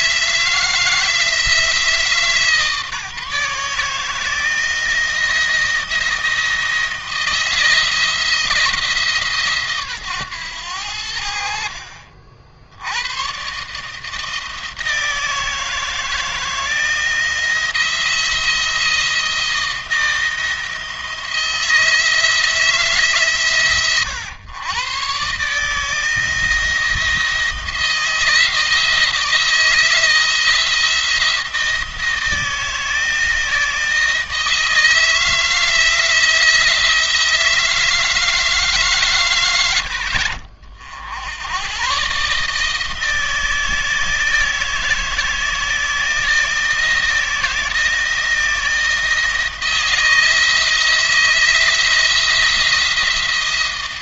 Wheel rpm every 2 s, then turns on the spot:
160, 160, 160, 160, 160, 100, 60, 160, 160, 170, 160, 150, 130, 160, 160, 170, 160, 160, 170, 150, 70, 150, 160, 160, 160, 160, 170.
none